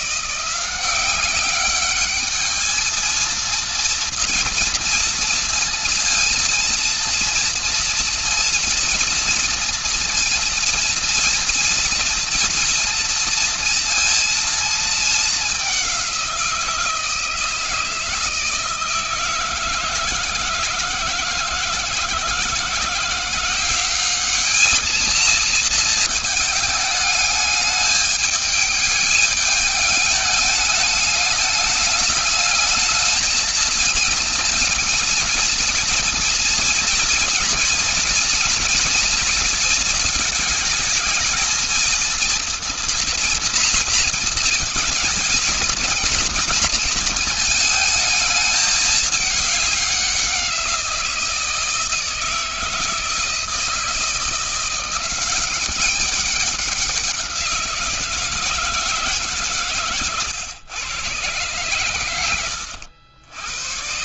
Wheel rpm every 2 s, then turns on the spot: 180, 220, 230, 230, 230, 230, 230, 220, 170, 160, 160, 160, 220, 210, 210, 210, 220, 230, 230, 230, 220, 230, 230, 230, 210, 180, 170, 180, 190, 160, 130, 90.
none